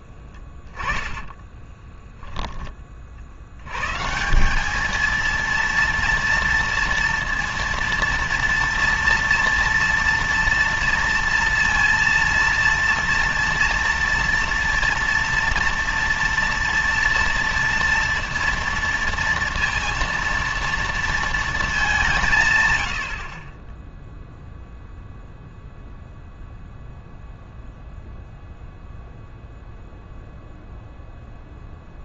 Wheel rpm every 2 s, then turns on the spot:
10, 20, 210, 230, 230, 230, 230, 230, 230, 230, 230, 110, 0, 0, 0, 0.
0-2 22-24